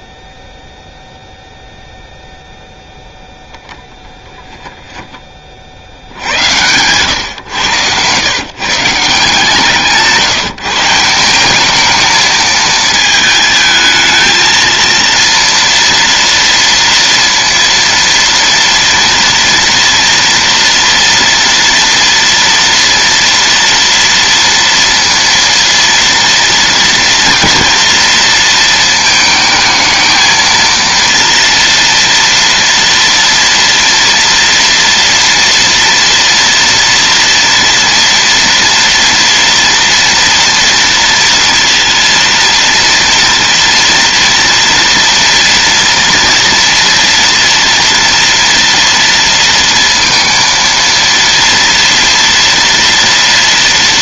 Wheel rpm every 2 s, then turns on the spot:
0, 0, 10, 80, 100, 160, 230, 220, 230, 230, 230, 230, 230, 230, 230, 220, 230, 230, 230, 230, 230, 230, 230, 230, 230, 230, 230.
none